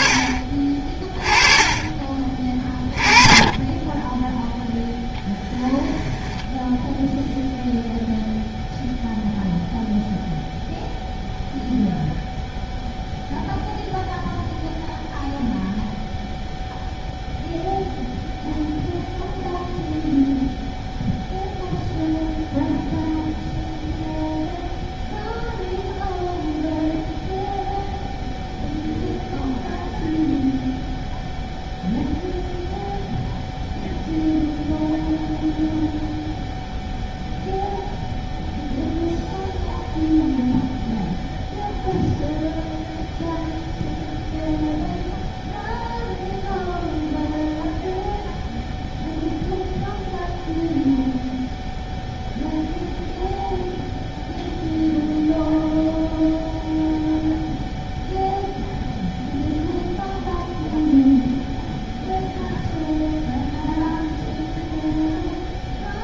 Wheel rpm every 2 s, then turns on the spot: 30, 20, 10, 10, 0, 0, 0, 0, 0, 0, 0, 0, 0, 0, 0, 0, 0, 0, 0, 0, 0, 0, 0, 0, 0, 0, 0, 0, 0, 0, 0, 0, 0.
6-8